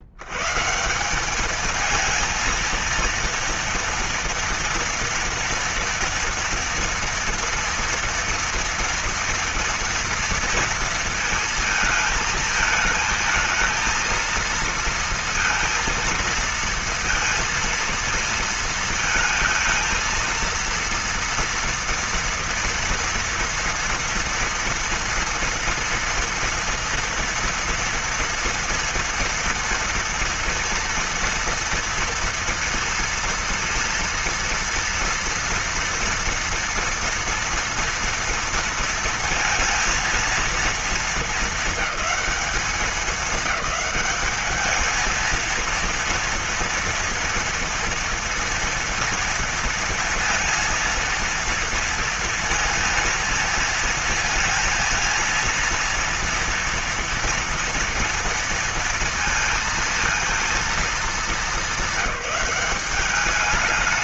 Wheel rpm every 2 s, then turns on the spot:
130, 230, 230, 230, 230, 230, 220, 230, 220, 230, 230, 230, 230, 230, 230, 230, 230, 230, 240, 230, 230, 200, 210, 230, 230, 230, 230, 230, 230, 230, 230, 200.
none